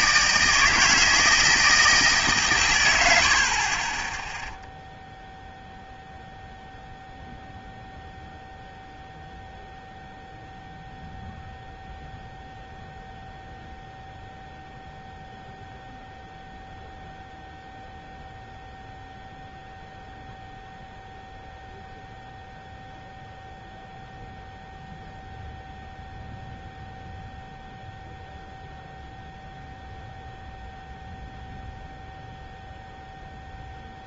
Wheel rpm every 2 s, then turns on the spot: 160, 130, 0, 0, 0, 0, 0, 0, 0, 0, 0, 0, 0, 0, 0, 0, 0.
none